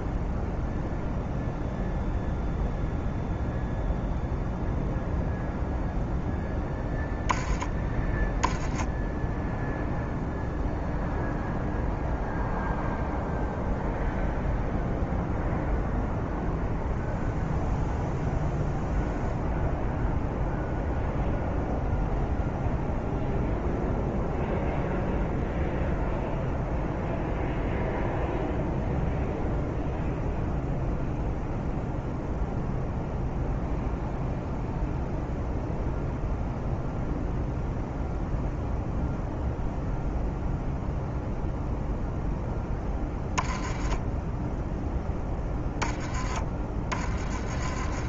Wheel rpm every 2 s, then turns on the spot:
0, 0, 0, 10, 10, 0, 0, 0, 0, 0, 0, 0, 0, 0, 0, 0, 0, 0, 0, 0, 0, 10, 0, 20.
none